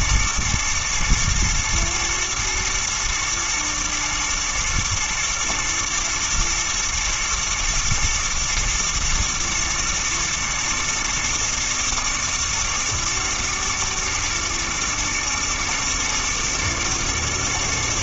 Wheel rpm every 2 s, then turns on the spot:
110, 110, 110, 120, 120, 110, 120, 110, 120.
none